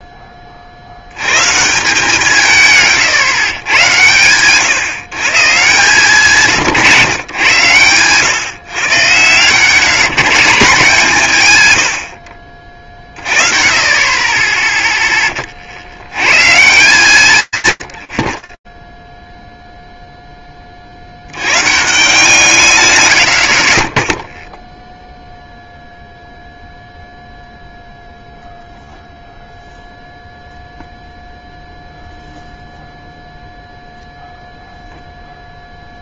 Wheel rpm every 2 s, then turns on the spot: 40, 140, 120, 150, 130, 170, 50, 10, 160, 50, 30, 140, 0, 0, 0, 0, 0, 0.
none